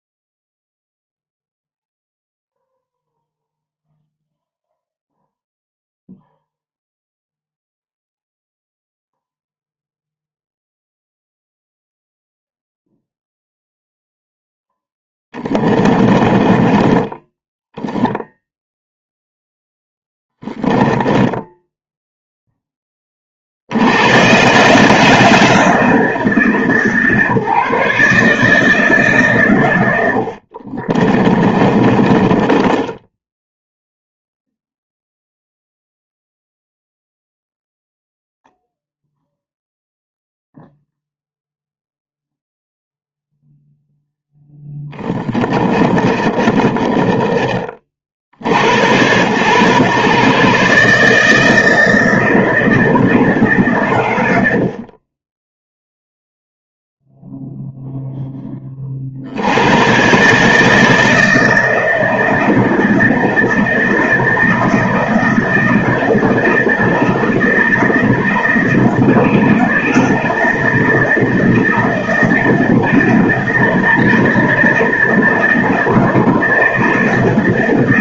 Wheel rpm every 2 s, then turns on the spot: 0, 0, 0, 0, 0, 0, 0, 10, 20, 0, 10, 20, 150, 150, 150, 40, 10, 0, 0, 0, 0, 0, 10, 30, 80, 150, 170, 60, 0, 30, 160, 160, 160, 170, 160, 160, 160, 160, 170.
14-18 20-22 30-34 44-48